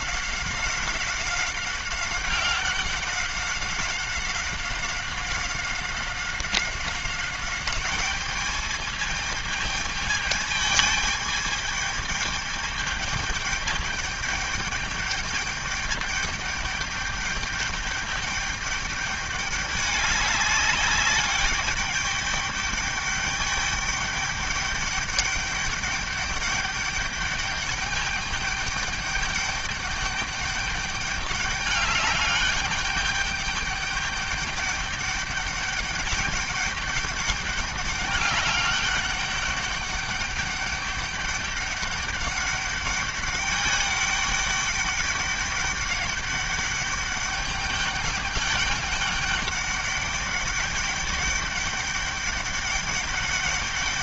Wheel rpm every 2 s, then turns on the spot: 190, 190, 190, 190, 210, 210, 210, 210, 210, 210, 200, 200, 200, 200, 210, 210, 200, 200, 200, 200, 200, 200, 200, 200, 200, 200, 200.
none